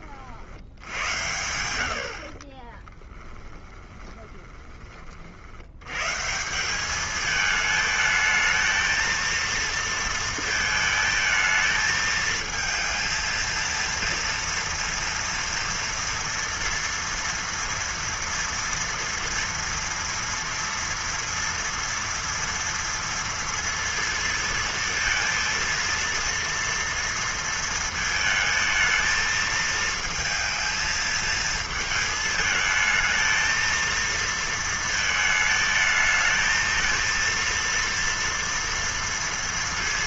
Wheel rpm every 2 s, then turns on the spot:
70, 30, 20, 180, 220, 220, 230, 230, 230, 230, 230, 230, 220, 230, 220, 230, 220, 230, 220, 230.
2-6